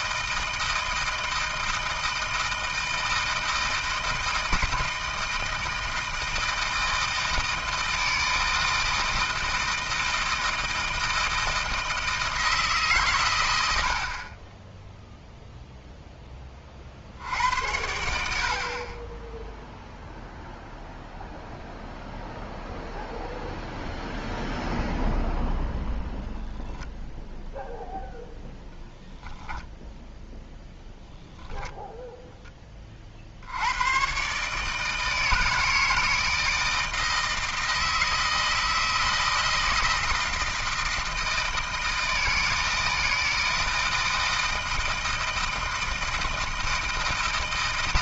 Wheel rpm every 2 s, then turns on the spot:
160, 160, 160, 160, 160, 160, 150, 10, 30, 40, 0, 0, 0, 0, 0, 0, 20, 150, 160, 160, 160, 160, 160, 160.
none